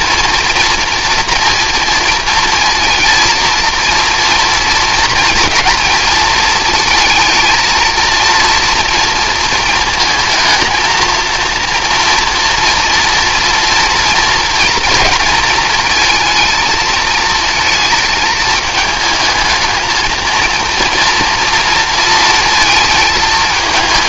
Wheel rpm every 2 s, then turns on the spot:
230, 230, 230, 220, 230, 220, 230, 230, 220, 220, 230, 230.
none